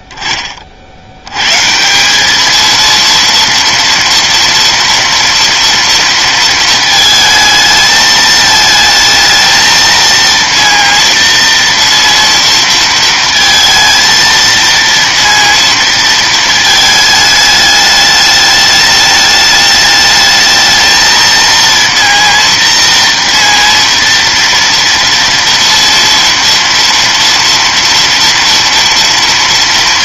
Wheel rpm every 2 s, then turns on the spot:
20, 220, 230, 230, 220, 230, 230, 230, 220, 210, 220, 230, 230, 230, 230.
none